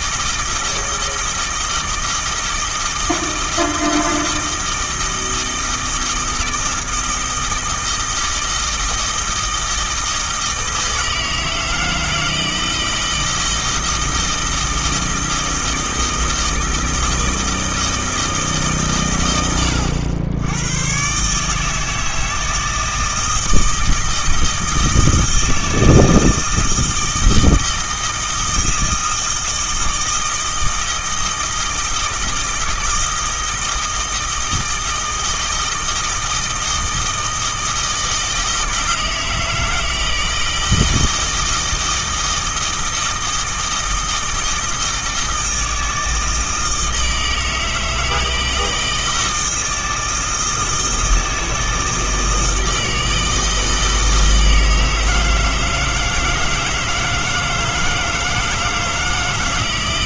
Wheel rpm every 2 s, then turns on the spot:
160, 160, 160, 160, 160, 160, 160, 160, 160, 130, 120, 160, 160, 160, 160, 160, 160, 160, 160, 160, 160, 160, 160, 160, 160, 160, 160, 160, 160, 160.
none